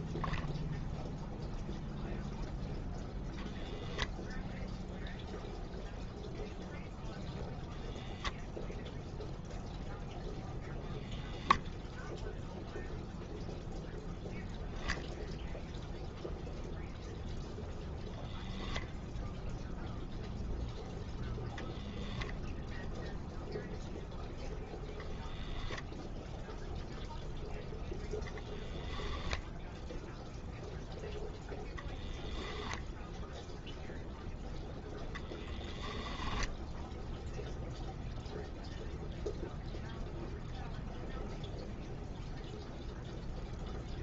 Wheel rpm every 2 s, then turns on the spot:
0, 0, 0, 0, 0, 10, 0, 0, 0, 0, 0, 0, 0, 0, 0, 0, 0, 0, 0, 0, 0, 0.
none